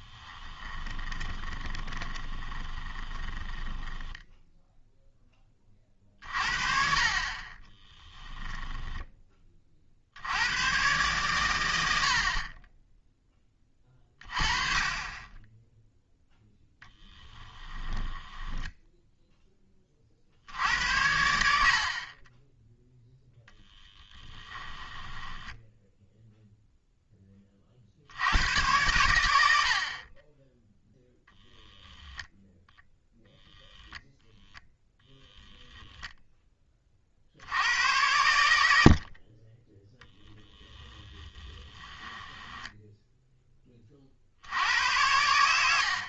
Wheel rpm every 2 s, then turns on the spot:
20, 20, 0, 40, 10, 110, 30, 30, 10, 10, 80, 0, 10, 0, 110, 10, 0, 0, 20, 80, 10, 10, 90.
0-4 8-10 18-20 24-26 40-44